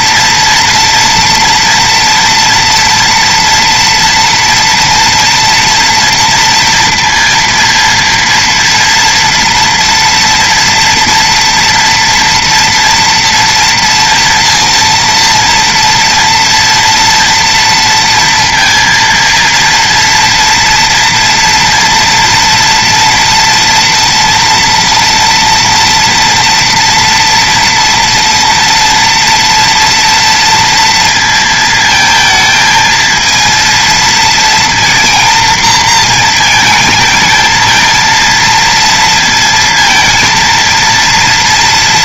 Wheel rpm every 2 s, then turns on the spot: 230, 230, 230, 230, 230, 230, 240, 230, 240, 230, 230, 230, 230, 230, 230, 230, 220, 230, 230, 230, 230.
none